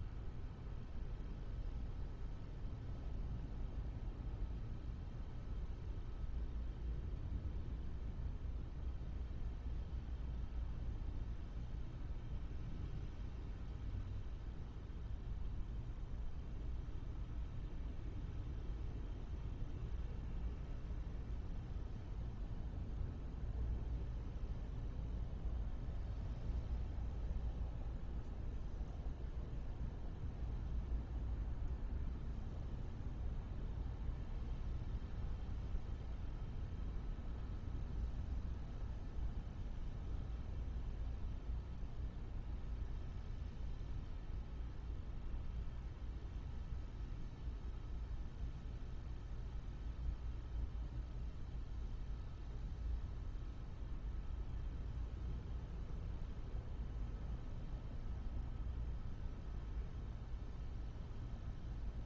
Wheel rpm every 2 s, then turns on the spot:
0, 0, 0, 0, 0, 0, 0, 0, 0, 0, 0, 0, 0, 0, 0, 0, 0, 0, 0, 0, 0, 0, 0, 0, 0, 0, 0, 0, 0, 0, 0.
none